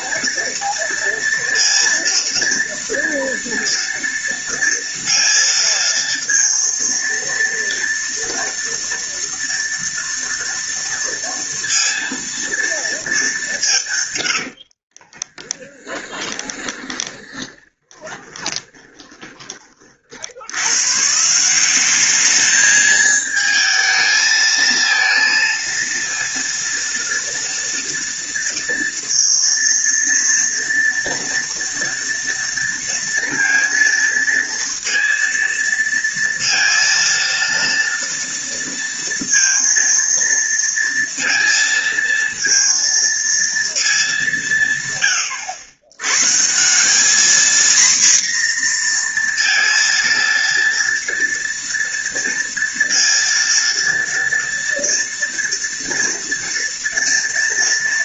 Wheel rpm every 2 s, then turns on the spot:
230, 230, 230, 230, 230, 230, 220, 50, 10, 20, 130, 220, 220, 230, 230, 230, 230, 230, 230, 230, 230, 230, 140, 190, 240, 230, 230, 230, 230.
14-20